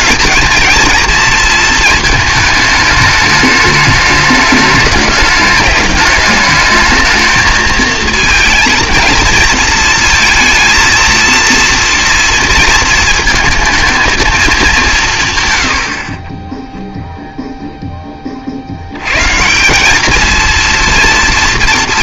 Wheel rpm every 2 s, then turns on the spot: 230, 220, 210, 220, 230, 230, 230, 210, 10, 50, 230.
16-18